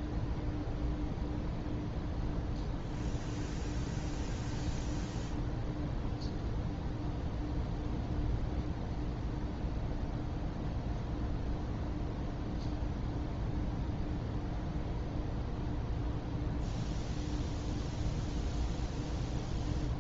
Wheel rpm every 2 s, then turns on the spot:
0, 0, 0, 0, 0, 0, 0, 0, 0, 0.
none